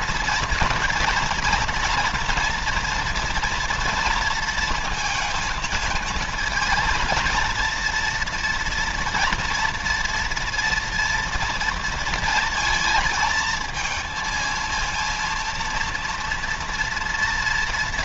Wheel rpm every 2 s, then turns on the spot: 240, 230, 220, 230, 240, 230, 220, 220, 230.
none